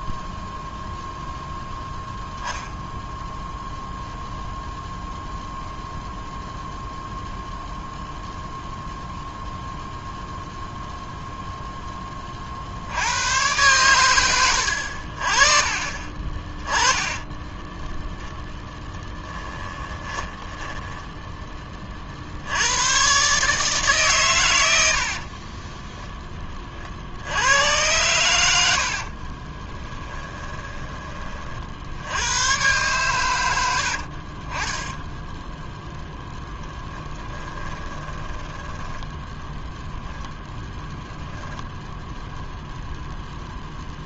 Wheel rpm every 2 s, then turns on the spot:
0, 0, 0, 0, 0, 0, 70, 80, 10, 10, 10, 100, 80, 40, 70, 20, 120, 20, 10, 10, 0, 0.
14-22 24-26 28-32 34-40